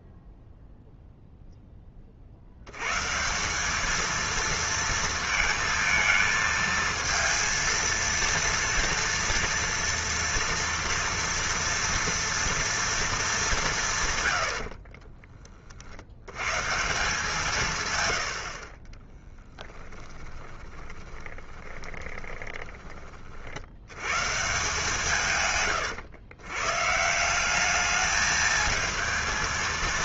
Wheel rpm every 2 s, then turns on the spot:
0, 90, 230, 220, 230, 230, 230, 90, 140, 50, 20, 20, 160, 120, 220.
18-24